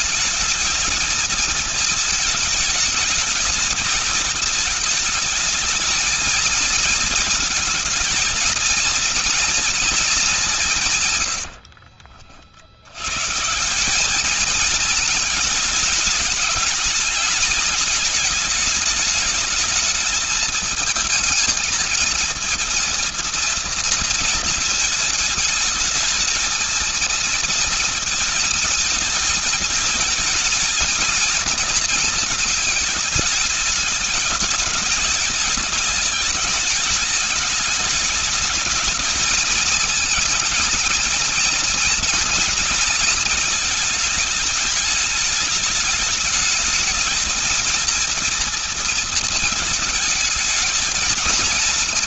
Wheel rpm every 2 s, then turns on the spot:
220, 220, 220, 220, 220, 140, 90, 220, 210, 210, 220, 230, 220, 230, 220, 220, 220, 210, 210, 220, 230, 230, 210, 220, 230, 220.
10-12